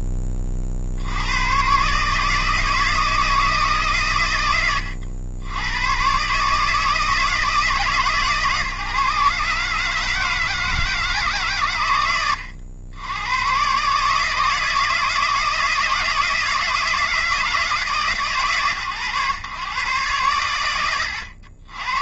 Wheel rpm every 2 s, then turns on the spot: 100, 160, 90, 160, 140, 160, 100, 160, 160, 110, 80.
none